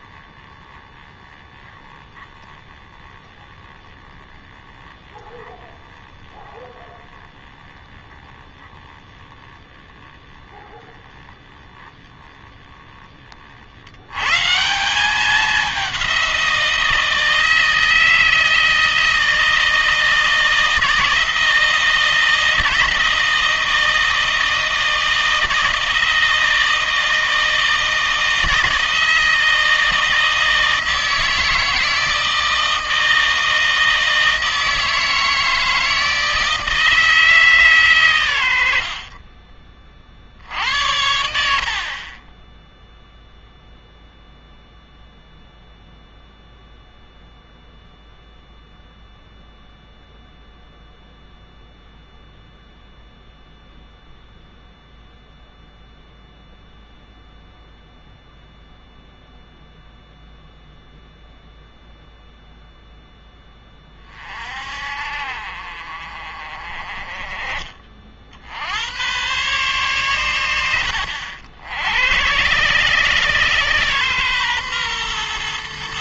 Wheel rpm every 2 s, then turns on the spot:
10, 10, 10, 10, 10, 10, 10, 170, 170, 160, 160, 160, 160, 160, 160, 160, 160, 160, 160, 60, 70, 0, 0, 0, 0, 0, 0, 0, 0, 0, 0, 0, 50, 30, 90, 70, 120, 120.
38-40